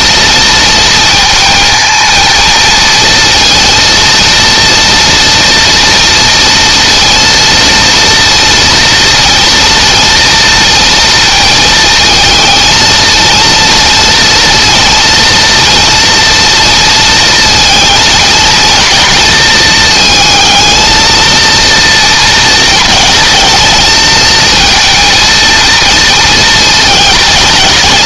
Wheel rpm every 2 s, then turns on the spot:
230, 230, 230, 230, 230, 230, 230, 230, 230, 240, 220, 230, 230, 230.
none